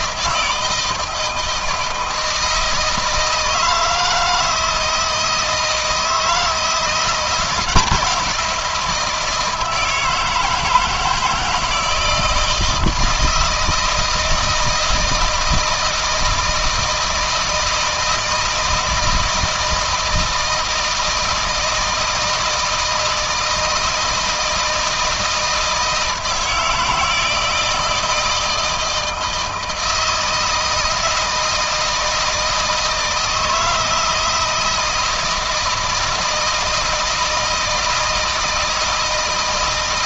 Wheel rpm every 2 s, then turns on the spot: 160, 160, 160, 170, 170, 160, 170, 160, 160, 160, 160, 160, 160, 160, 160, 160, 160, 160, 160, 160.
none